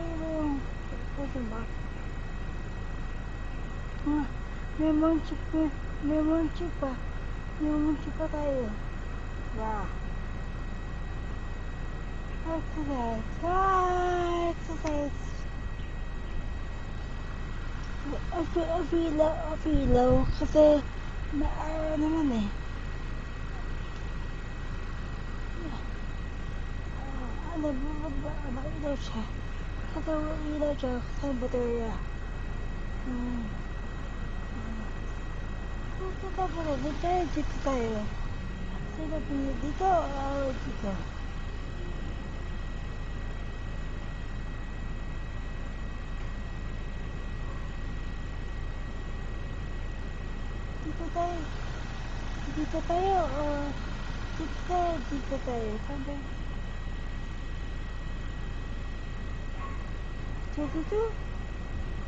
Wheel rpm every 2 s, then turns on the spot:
0, 0, 0, 0, 0, 0, 0, 0, 0, 0, 0, 0, 0, 0, 0, 0, 0, 0, 0, 0, 0, 0, 0, 0, 0, 0, 0, 0, 0, 0, 0.
none